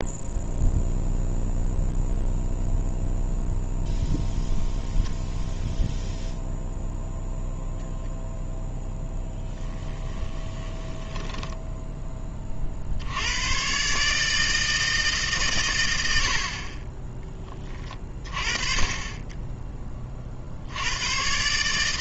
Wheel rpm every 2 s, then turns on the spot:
0, 0, 0, 0, 0, 20, 40, 160, 30, 30, 80.
10-12